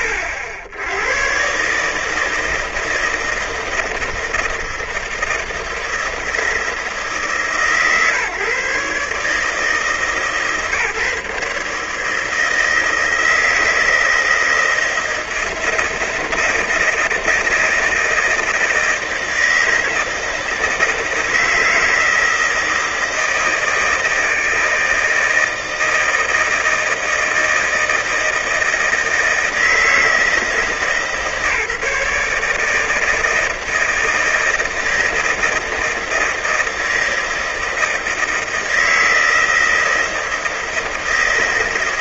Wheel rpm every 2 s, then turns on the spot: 80, 160, 160, 160, 140, 140, 160, 160, 160, 160, 160, 160, 160, 160, 160, 160, 160, 160, 160, 160, 160.
none